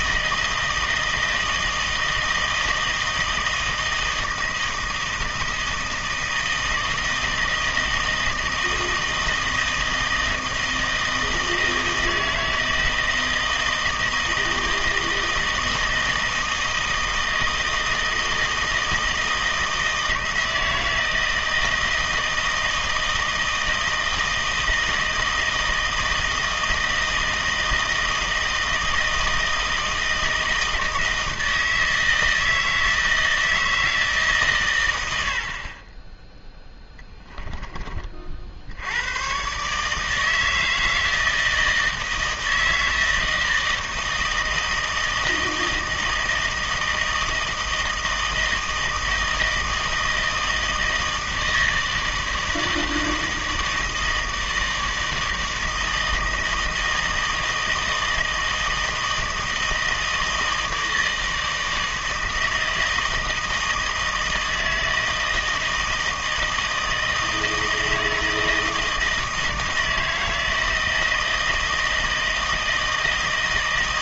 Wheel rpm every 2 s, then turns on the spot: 160, 160, 160, 160, 160, 160, 160, 160, 160, 160, 160, 160, 160, 160, 160, 160, 160, 120, 10, 80, 160, 160, 160, 160, 160, 160, 160, 160, 160, 160, 160, 160, 160, 160, 160, 160, 160.
36-38